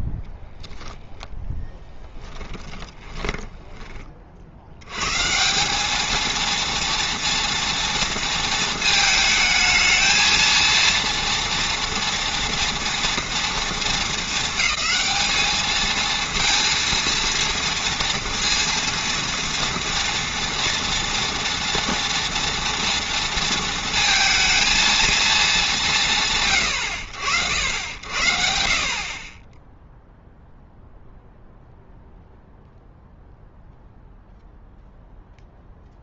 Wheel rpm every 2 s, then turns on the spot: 0, 10, 60, 230, 230, 230, 230, 210, 230, 240, 230, 230, 230, 130, 60, 0, 0, 0.
2-4